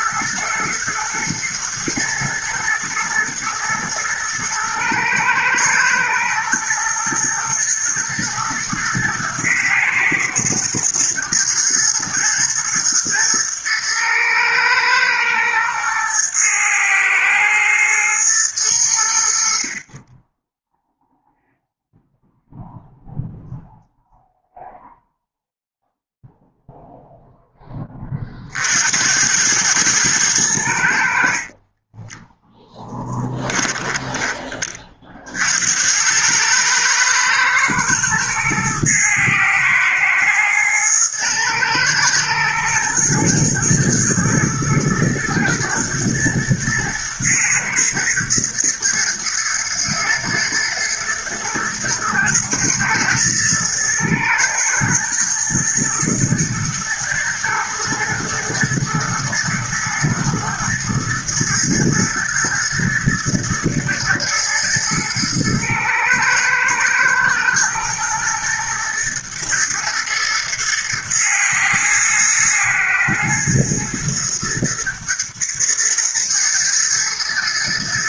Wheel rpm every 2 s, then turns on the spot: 110, 110, 110, 120, 110, 110, 120, 110, 110, 80, 0, 0, 0, 0, 80, 60, 10, 40, 110, 110, 110, 110, 110, 110, 110, 120, 110, 110, 120, 120, 120, 110, 110, 120, 120, 120, 110, 120, 110.
none